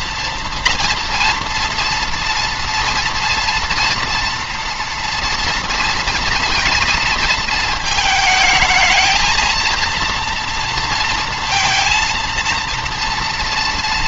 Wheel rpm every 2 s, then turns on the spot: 230, 240, 230, 230, 220, 230, 230.
none